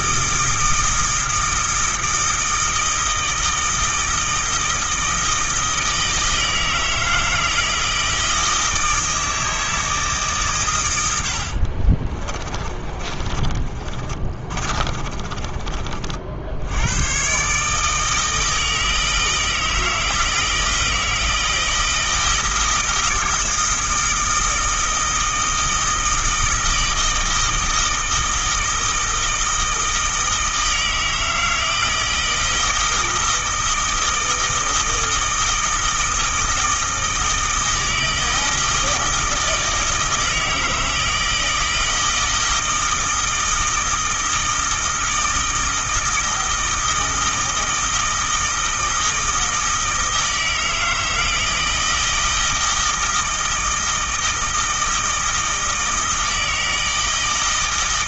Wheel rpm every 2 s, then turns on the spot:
160, 160, 160, 160, 160, 110, 30, 30, 90, 160, 160, 160, 160, 160, 160, 160, 160, 160, 160, 160, 160, 160, 160, 160, 160, 160, 160, 160, 160.
12-16